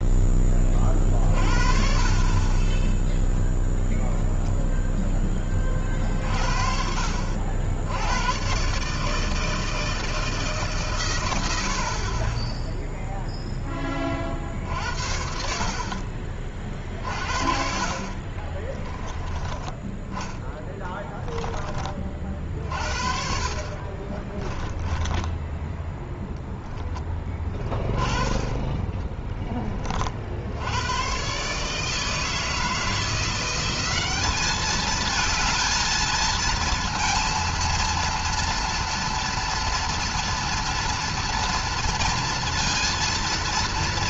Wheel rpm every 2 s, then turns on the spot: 20, 20, 0, 50, 140, 140, 10, 50, 40, 30, 10, 50, 20, 10, 20, 90, 160, 210, 230, 230, 230, 230.
18-20 24-26 28-30